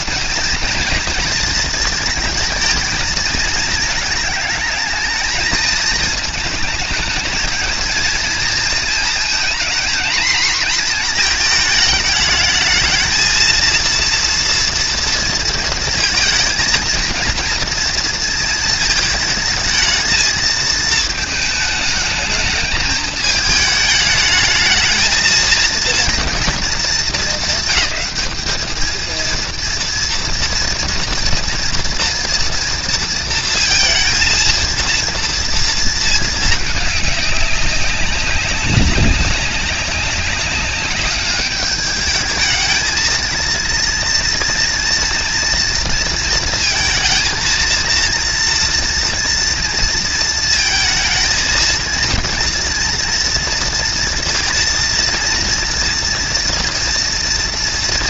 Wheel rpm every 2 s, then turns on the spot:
230, 230, 220, 220, 230, 230, 220, 230, 230, 220, 220, 220, 220, 210, 220, 230, 230, 230, 210, 200, 200, 220, 240, 230, 230, 220, 230, 230, 240.
none